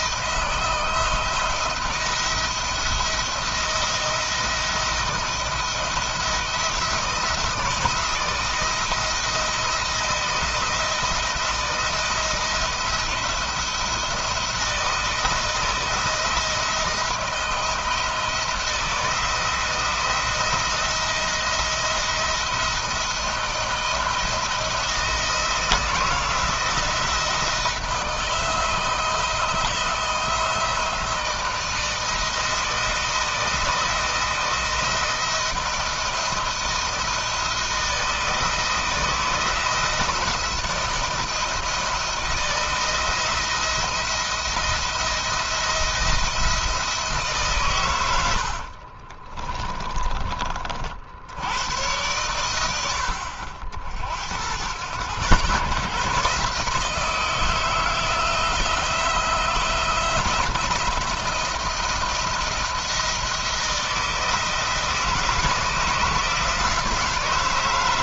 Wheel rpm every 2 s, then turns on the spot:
170, 170, 170, 170, 170, 160, 170, 170, 160, 170, 170, 170, 170, 160, 160, 160, 160, 160, 160, 160, 170, 170, 170, 170, 60, 40, 90, 100, 150, 160, 170, 170, 160, 160.
48-50